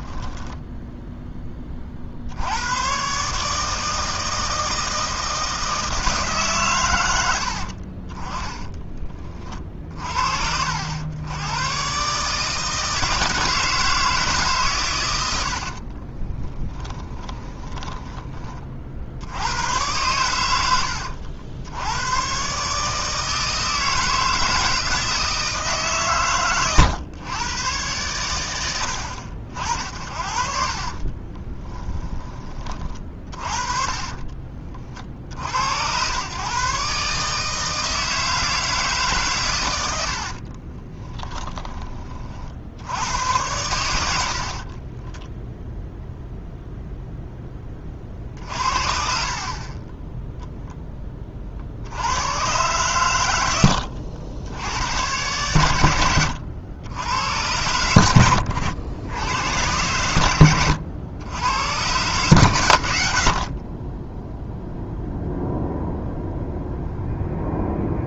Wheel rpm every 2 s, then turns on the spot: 10, 110, 160, 120, 20, 70, 160, 110, 10, 50, 90, 140, 160, 120, 90, 40, 30, 40, 140, 160, 20, 80, 20, 0, 50, 10, 110, 100, 100, 80, 90, 100, 0, 0.
0-2 8-10 16-18 30-32 40-42 44-46